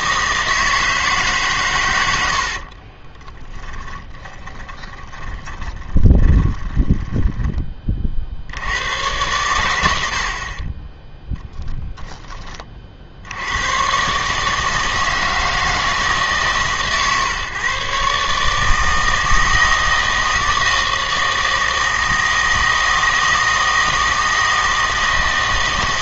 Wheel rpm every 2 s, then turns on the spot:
160, 40, 20, 10, 80, 30, 40, 150, 140, 150, 160, 160, 160.
2-8